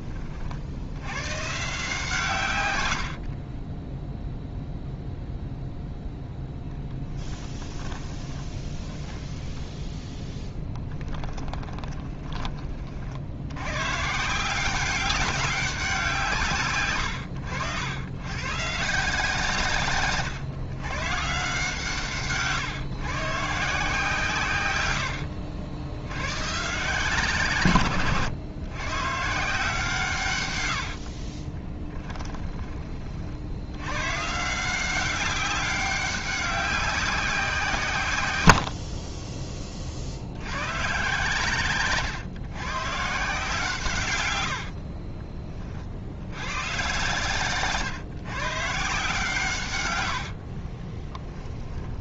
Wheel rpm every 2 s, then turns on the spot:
90, 90, 0, 10, 20, 10, 40, 190, 120, 150, 120, 130, 100, 130, 120, 90, 30, 190, 190, 60, 120, 130, 50, 120, 150, 30.
2-4 6-12 30-32 38-40 44-46 50-52